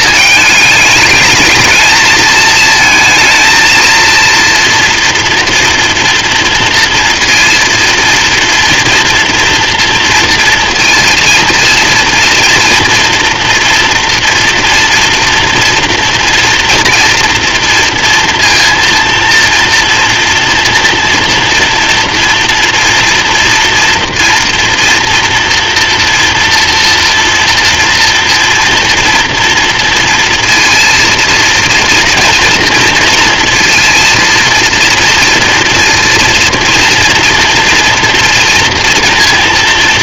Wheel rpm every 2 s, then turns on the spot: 220, 220, 230, 230, 240, 230, 230, 230, 230, 230, 230, 230, 230, 230, 230, 230, 230, 230, 230, 230.
none